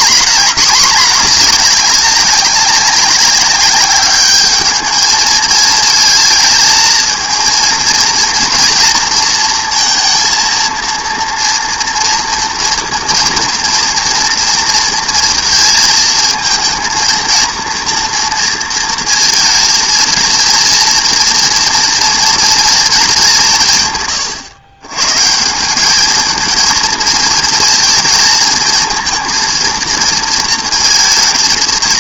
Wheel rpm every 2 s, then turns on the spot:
220, 190, 210, 220, 240, 230, 230, 230, 230, 230, 230, 230, 120, 220, 220, 230.
none